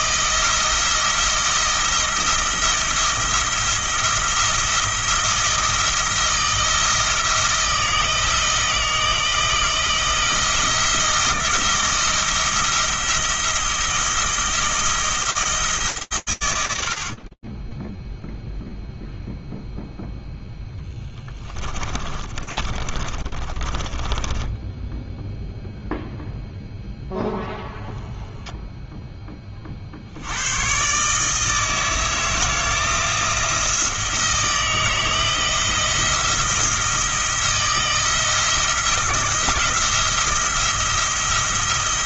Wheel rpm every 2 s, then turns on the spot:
170, 170, 170, 160, 160, 170, 170, 160, 70, 0, 10, 30, 10, 0, 20, 150, 170, 160, 170, 170, 170.
20-24